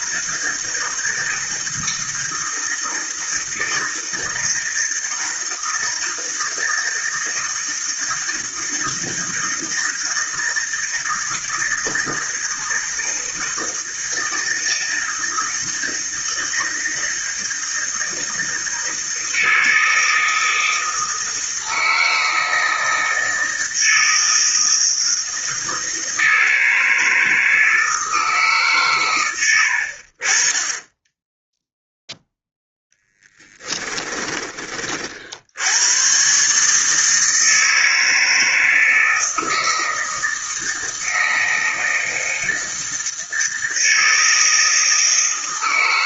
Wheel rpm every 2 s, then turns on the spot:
160, 160, 160, 160, 160, 160, 160, 160, 160, 160, 160, 160, 160, 160, 140, 20, 0, 30, 140, 160, 160, 160, 160.
none